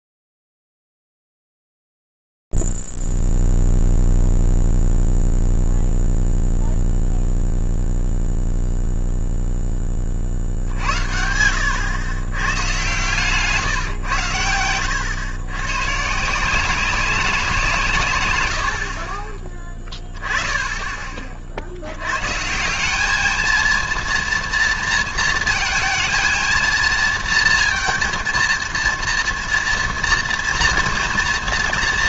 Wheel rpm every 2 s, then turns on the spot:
0, 0, 0, 0, 0, 30, 120, 110, 150, 140, 20, 120, 230, 230, 230, 230.
none